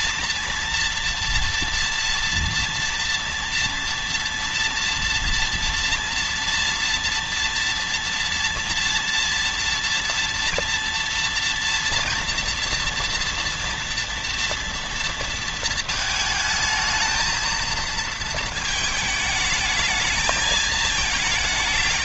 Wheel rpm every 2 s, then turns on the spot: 230, 230, 230, 230, 230, 230, 230, 230, 220, 220, 220.
none